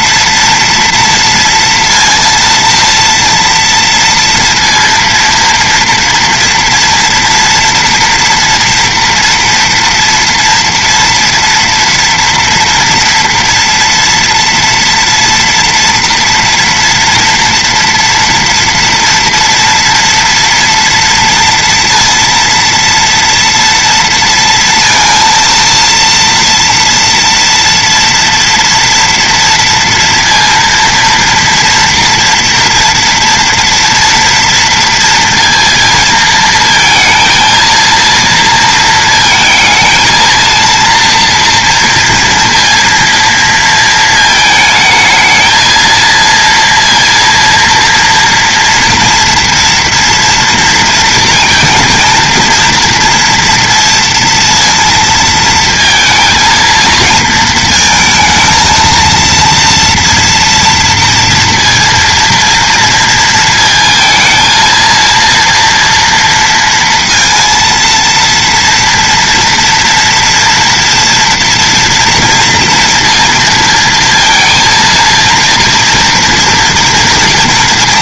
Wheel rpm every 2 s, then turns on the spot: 230, 230, 230, 230, 230, 230, 230, 230, 230, 230, 230, 230, 230, 240, 230, 230, 230, 230, 230, 230, 230, 230, 220, 230, 230, 240, 230, 230, 230, 220, 230, 230, 230, 230, 230, 230, 230, 230, 230.
none